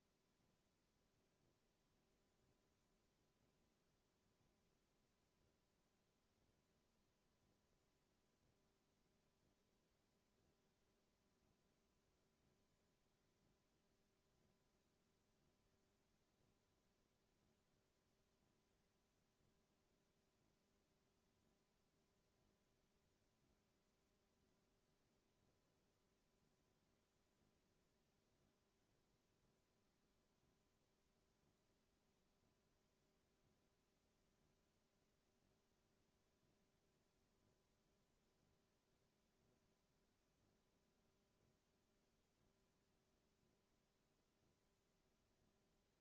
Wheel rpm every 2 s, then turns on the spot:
0, 0, 0, 0, 0, 0, 0, 0, 0, 0, 0, 0, 0, 0, 0, 0, 0, 0, 0, 0, 0, 0, 0.
none